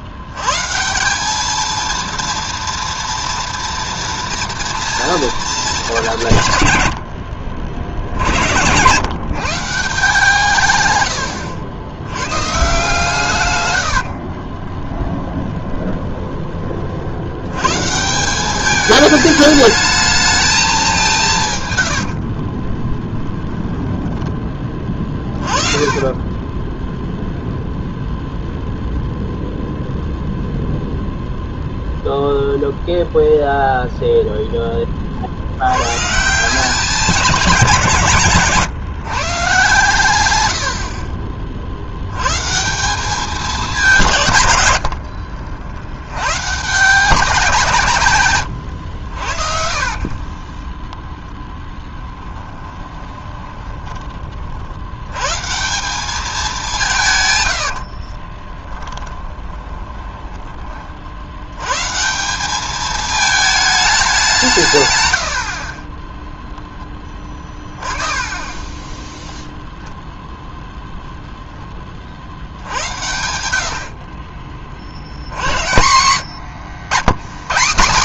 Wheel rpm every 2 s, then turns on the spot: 150, 230, 230, 120, 100, 130, 150, 30, 40, 200, 210, 30, 20, 20, 0, 0, 0, 10, 190, 140, 80, 160, 100, 150, 100, 20, 20, 60, 190, 10, 30, 200, 150, 10, 10, 0, 70, 50, 110.
14-16 22-24 26-28 48-54 58-60